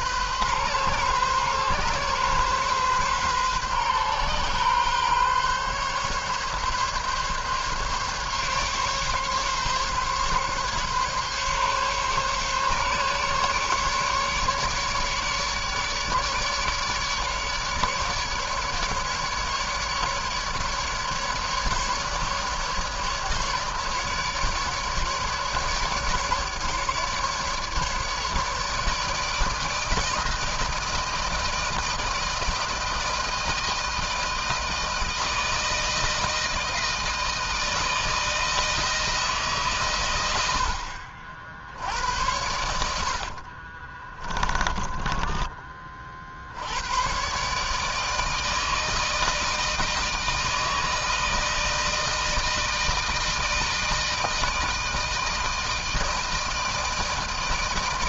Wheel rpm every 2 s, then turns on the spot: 130, 130, 130, 140, 140, 140, 140, 150, 150, 150, 150, 150, 150, 150, 150, 160, 160, 160, 160, 160, 70, 80, 30, 110, 160, 160, 160, 160, 160.
42-46